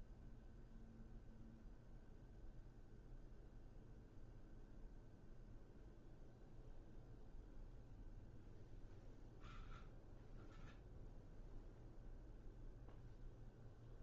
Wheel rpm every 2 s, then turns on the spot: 0, 0, 0, 0, 0, 0, 0.
none